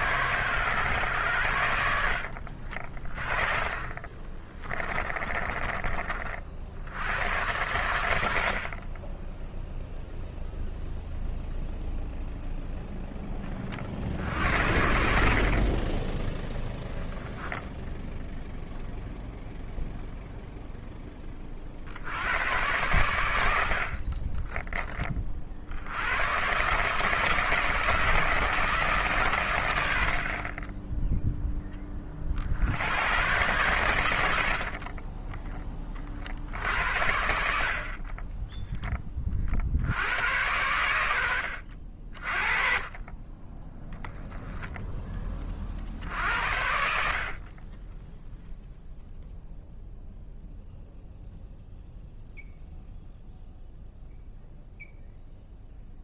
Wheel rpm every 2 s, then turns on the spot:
110, 50, 20, 70, 30, 0, 0, 60, 0, 0, 0, 90, 20, 150, 150, 30, 90, 50, 80, 10, 90, 30, 10, 70, 0, 0, 0, 0.
4-6 34-36